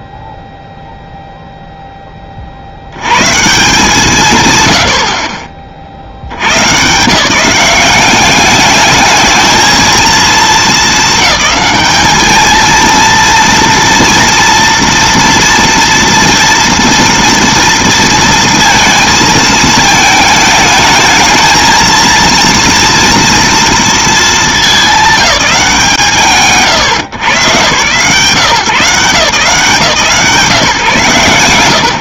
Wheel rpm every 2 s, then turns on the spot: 0, 140, 10, 150, 220, 210, 230, 230, 230, 220, 220, 230, 190, 120, 160, 130.
none